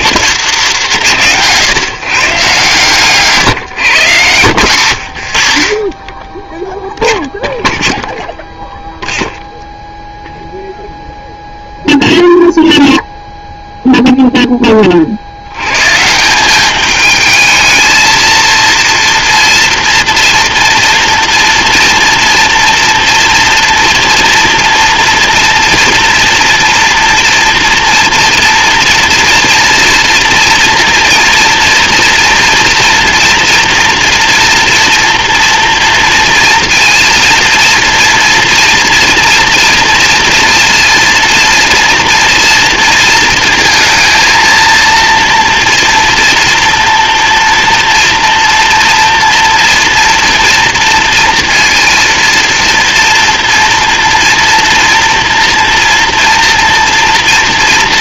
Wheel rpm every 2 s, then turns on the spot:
180, 140, 120, 0, 0, 0, 0, 30, 200, 230, 230, 230, 230, 230, 230, 240, 230, 230, 230, 240, 230, 230, 230, 230, 240, 240, 230, 230, 230.
none